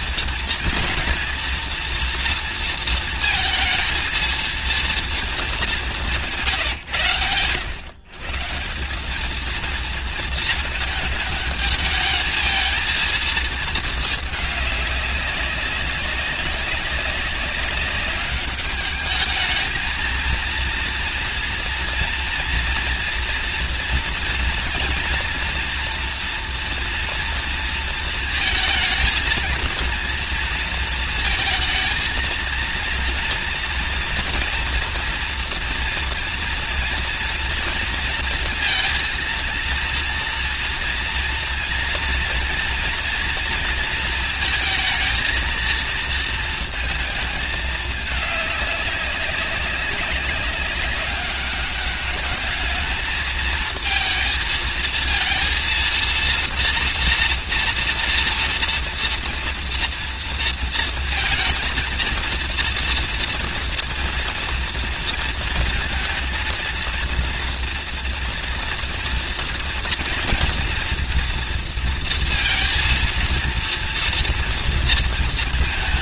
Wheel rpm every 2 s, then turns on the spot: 230, 230, 230, 160, 180, 220, 220, 210, 190, 200, 230, 230, 230, 230, 230, 230, 230, 230, 230, 230, 230, 230, 230, 220, 200, 190, 220, 230, 240, 240, 230, 230, 230, 230, 240, 240, 230, 230.
none